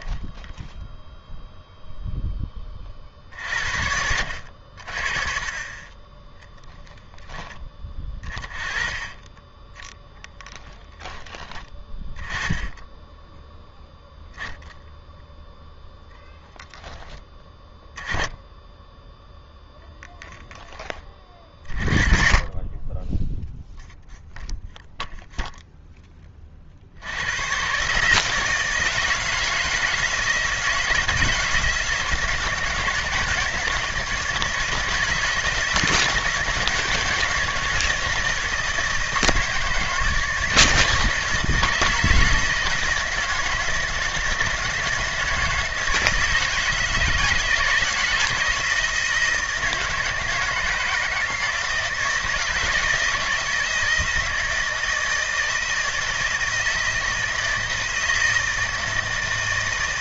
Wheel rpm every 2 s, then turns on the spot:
0, 30, 60, 0, 20, 10, 10, 0, 10, 10, 10, 30, 0, 40, 160, 170, 160, 160, 160, 160, 160, 160, 160, 160, 170, 160, 170, 160, 160, 160.
10-12